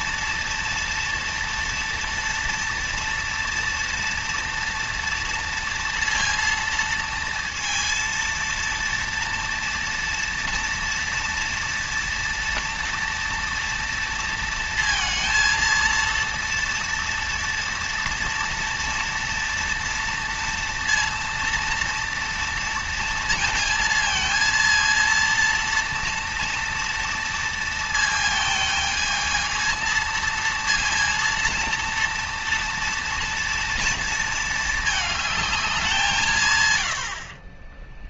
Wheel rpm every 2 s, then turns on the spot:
230, 230, 230, 230, 230, 230, 230, 230, 230, 230, 230, 230, 230, 230, 220, 230, 230, 220, 130.
none